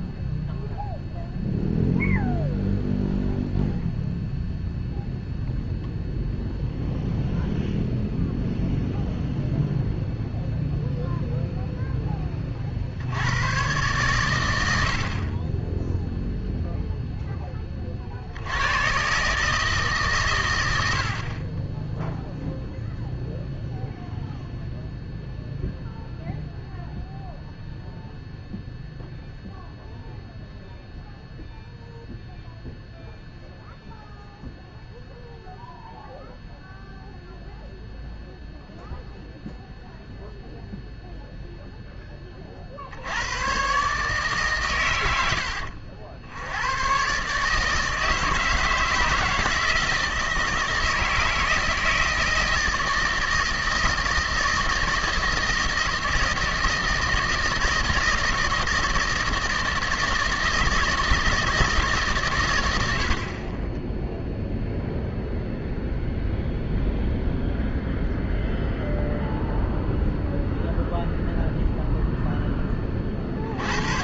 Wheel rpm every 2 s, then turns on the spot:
0, 0, 0, 0, 0, 0, 70, 70, 0, 110, 90, 0, 0, 0, 0, 0, 0, 0, 0, 0, 0, 70, 120, 120, 170, 160, 160, 160, 160, 170, 160, 90, 0, 0, 0, 0, 40.
none